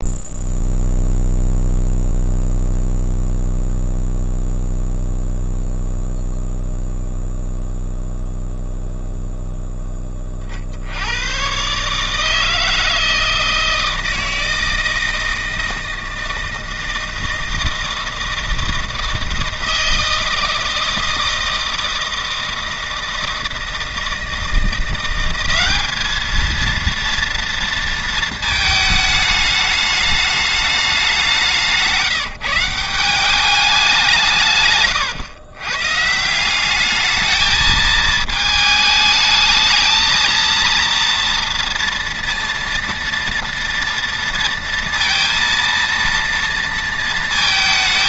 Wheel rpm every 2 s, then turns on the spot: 0, 0, 0, 0, 0, 110, 160, 160, 160, 160, 160, 160, 180, 230, 210, 190, 190, 120, 220, 220, 230, 230, 230, 230.
none